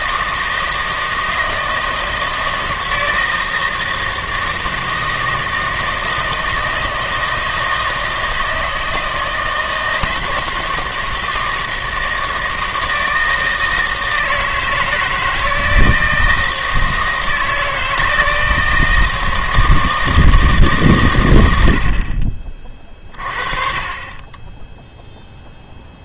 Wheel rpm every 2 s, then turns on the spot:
160, 160, 160, 160, 160, 160, 160, 160, 160, 160, 130, 30, 0.
none